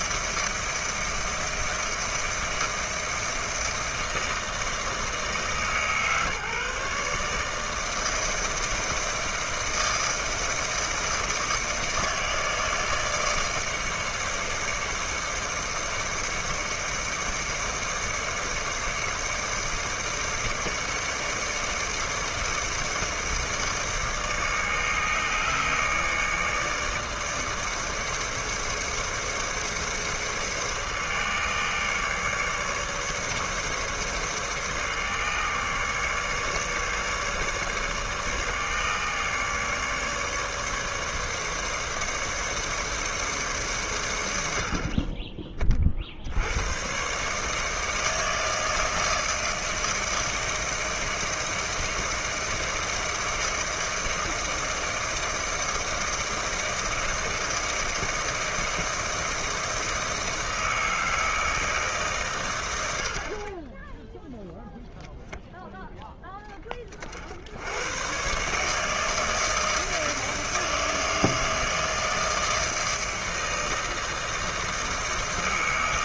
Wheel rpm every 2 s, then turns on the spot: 160, 160, 160, 150, 160, 160, 160, 150, 150, 150, 160, 160, 150, 150, 150, 150, 150, 150, 150, 150, 150, 150, 70, 110, 160, 160, 160, 160, 160, 160, 160, 90, 0, 30, 150, 160, 160, 160.
none